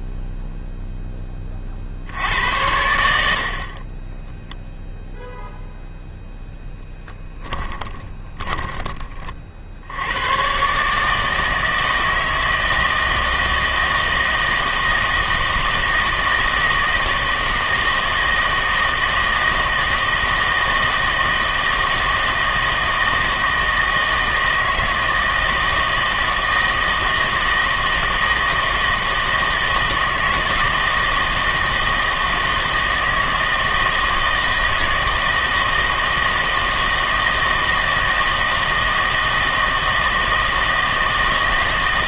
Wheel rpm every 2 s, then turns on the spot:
0, 80, 0, 0, 20, 140, 160, 160, 160, 160, 160, 160, 160, 160, 160, 160, 160, 160, 160, 160, 160.
none